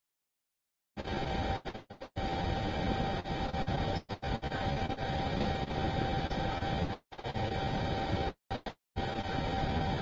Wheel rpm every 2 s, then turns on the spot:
0, 0, 0, 0, 0.
none